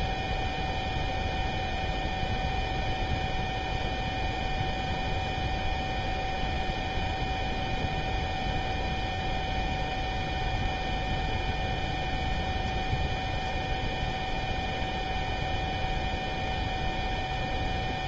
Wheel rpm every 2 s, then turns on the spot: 0, 0, 0, 0, 0, 0, 0, 0, 0.
none